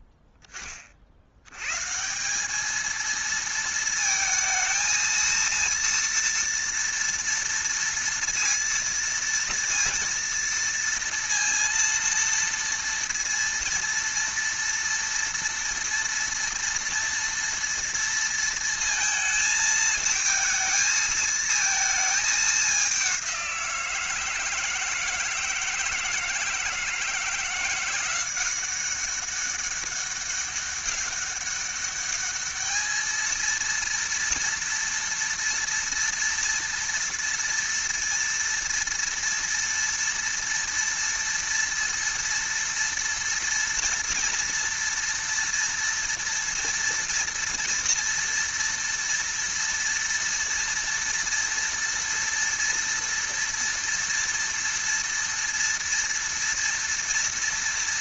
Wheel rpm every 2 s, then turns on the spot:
10, 210, 220, 230, 230, 230, 230, 230, 230, 230, 220, 200, 160, 160, 190, 200, 220, 230, 230, 230, 230, 230, 230, 230, 230, 230, 230, 230, 230.
none